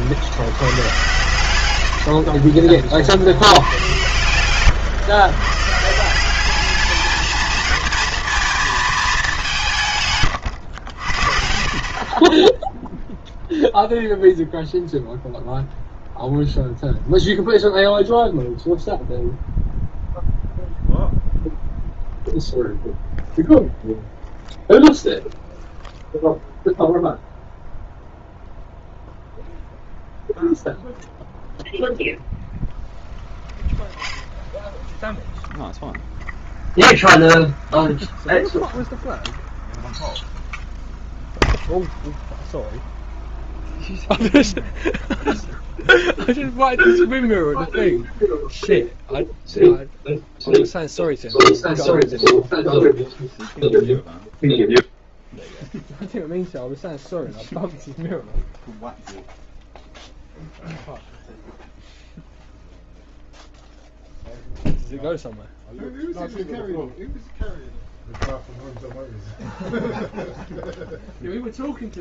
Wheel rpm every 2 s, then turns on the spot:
90, 40, 110, 200, 220, 100, 10, 0, 0, 0, 0, 0, 0, 0, 0, 0, 0, 0, 0, 0, 0, 0, 0, 0, 0, 0, 0, 0, 0, 0, 0, 0, 0, 0, 0, 0.
2-4